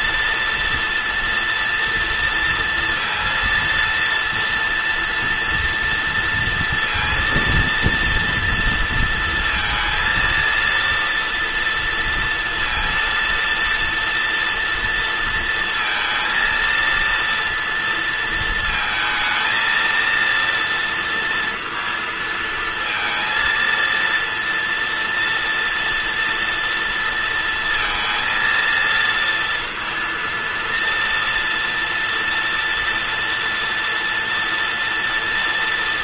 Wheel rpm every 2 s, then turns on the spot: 240, 230, 230, 230, 230, 230, 230, 230, 230, 230, 230, 230, 230, 230, 230, 230, 230, 230.
none